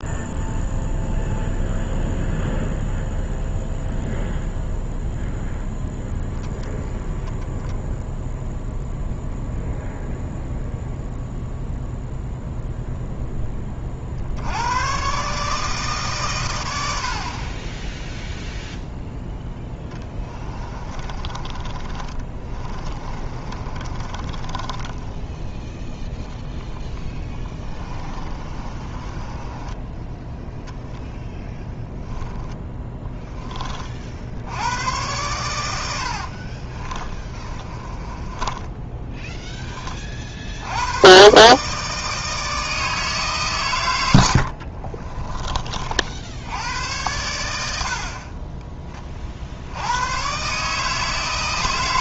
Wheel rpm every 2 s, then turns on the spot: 0, 0, 0, 10, 0, 0, 0, 110, 80, 0, 20, 30, 20, 10, 30, 0, 10, 100, 30, 10, 90, 160, 40, 100, 20, 150.
20-30 36-40 44-46